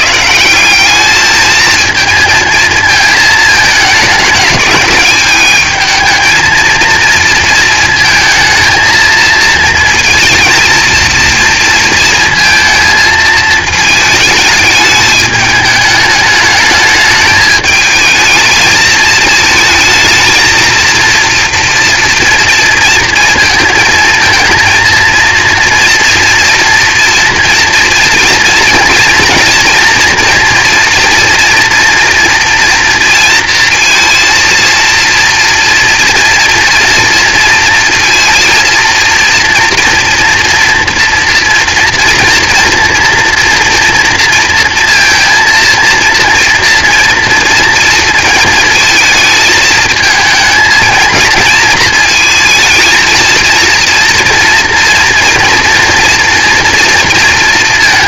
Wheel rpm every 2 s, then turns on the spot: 200, 220, 210, 220, 230, 230, 220, 210, 210, 220, 230, 230, 230, 230, 230, 240, 230, 230, 230, 230, 230, 230, 230, 240, 220, 230, 220, 230, 230.
none